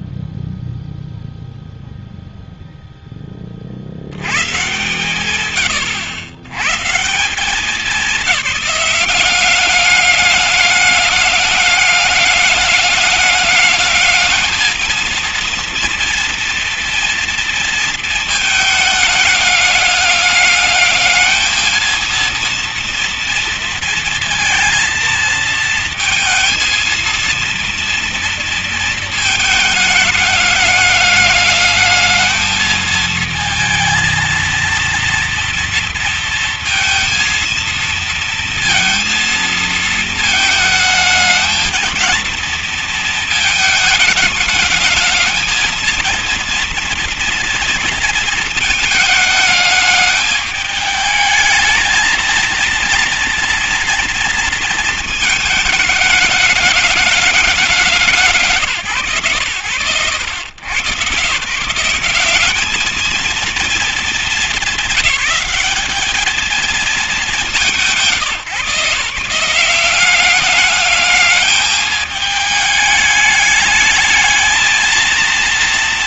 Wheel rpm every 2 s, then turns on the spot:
0, 20, 140, 190, 200, 200, 210, 230, 230, 210, 210, 230, 230, 230, 220, 210, 220, 230, 230, 230, 220, 220, 220, 230, 210, 220, 240, 220, 210, 110, 140, 220, 190, 190, 170, 210, 210, 230.
none